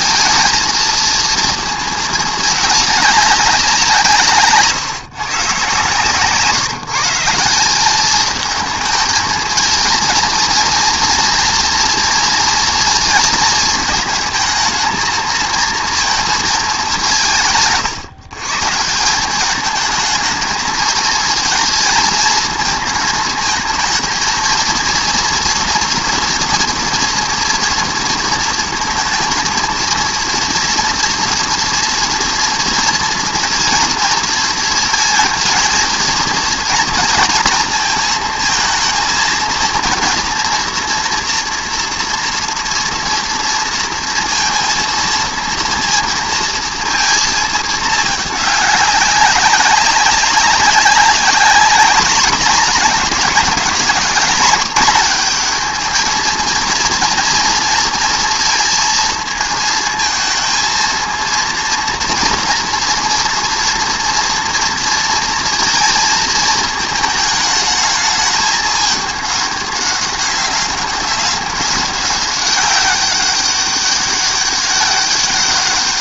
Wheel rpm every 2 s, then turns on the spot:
220, 210, 140, 150, 220, 230, 230, 220, 200, 150, 220, 220, 230, 230, 230, 230, 230, 230, 240, 230, 230, 230, 230, 230, 200, 200, 200, 200, 230, 230, 230, 230, 230, 220, 210, 190, 200, 190.
none